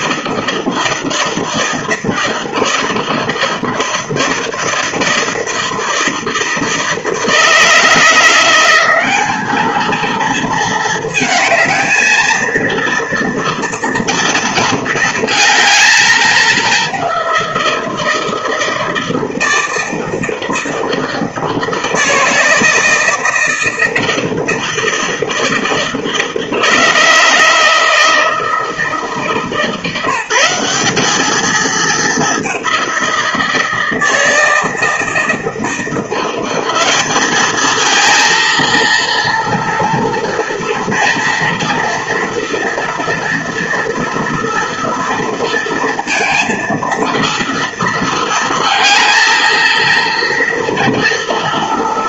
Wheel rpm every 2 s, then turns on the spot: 160, 160, 160, 160, 190, 220, 230, 220, 200, 160, 160, 160, 160, 160, 160, 200, 180, 160, 200, 230, 230, 230, 230, 230, 230, 230.
none